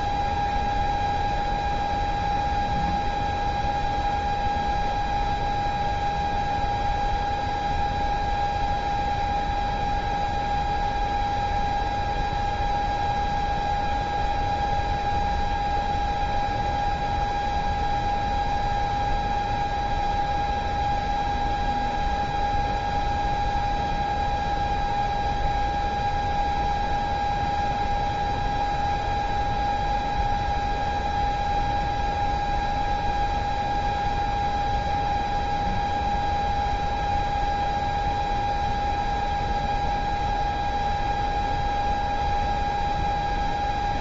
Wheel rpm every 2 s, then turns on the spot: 0, 0, 0, 0, 0, 0, 0, 0, 0, 0, 0, 0, 0, 0, 0, 0, 0, 0, 0, 0, 0, 0.
none